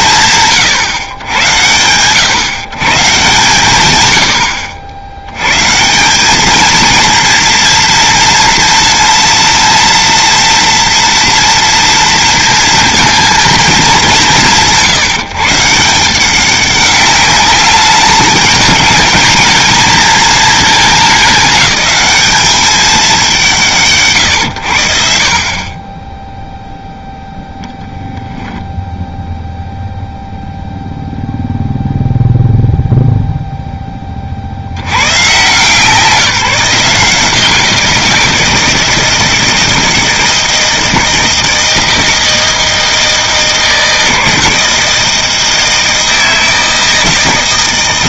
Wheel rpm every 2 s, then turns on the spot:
150, 140, 90, 220, 230, 230, 230, 180, 190, 210, 220, 210, 100, 0, 10, 0, 0, 70, 170, 160, 160, 160, 160, 160.
none